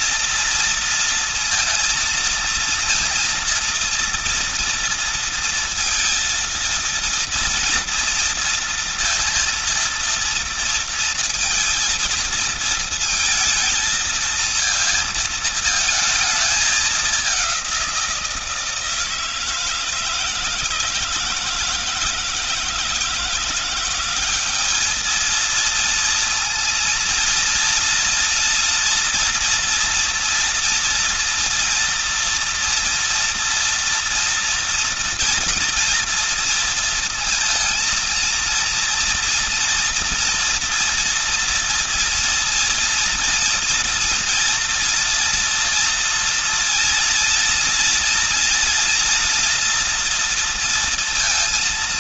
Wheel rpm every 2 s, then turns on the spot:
230, 230, 230, 230, 230, 230, 230, 230, 210, 170, 160, 160, 200, 230, 230, 230, 240, 230, 230, 230, 230, 230, 230, 230, 230, 230.
none